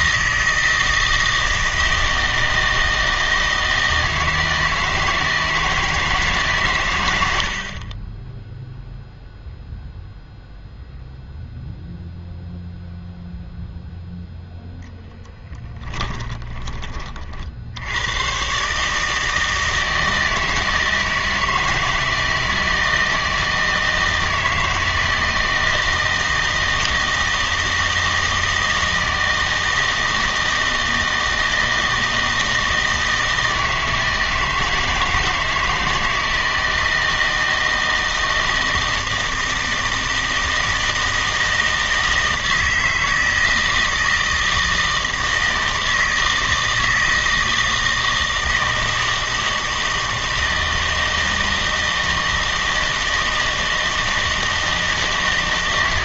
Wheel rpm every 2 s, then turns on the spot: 160, 160, 160, 140, 0, 0, 0, 0, 20, 130, 160, 160, 160, 160, 160, 160, 160, 160, 160, 160, 160, 160, 160, 160, 160, 160, 160, 160.
none